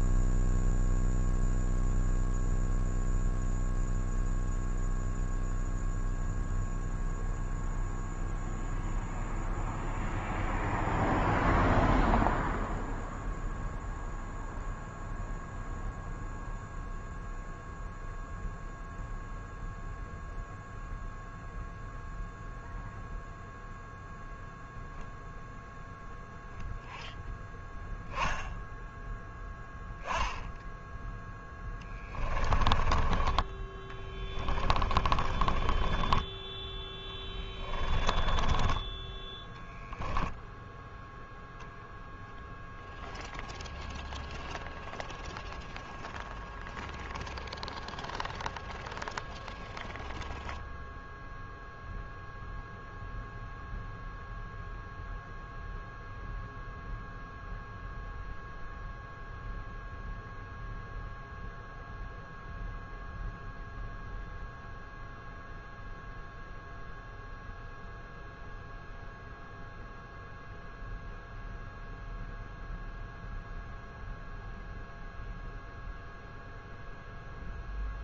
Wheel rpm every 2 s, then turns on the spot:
0, 0, 0, 0, 0, 0, 0, 0, 0, 0, 0, 0, 0, 0, 0, 0, 20, 20, 10, 10, 0, 0, 0, 0, 0, 0, 0, 0, 0, 0, 0, 0, 0, 0, 0, 0, 0, 0, 0.
32-36